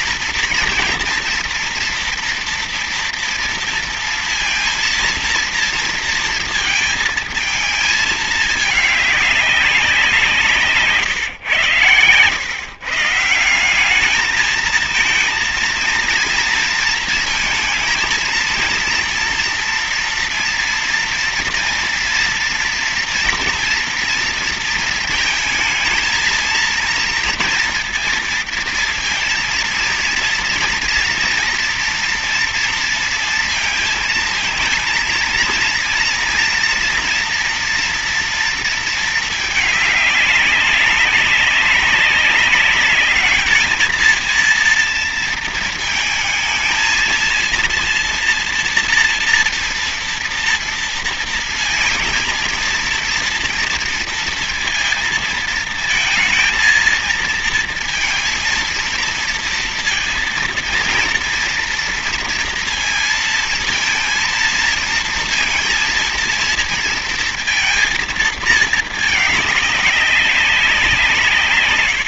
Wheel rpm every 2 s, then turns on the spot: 230, 230, 230, 220, 210, 160, 130, 220, 230, 230, 230, 240, 230, 230, 230, 230, 230, 220, 240, 230, 200, 200, 230, 220, 230, 230, 230, 230, 230, 230, 230, 230, 230, 230, 220, 180.
none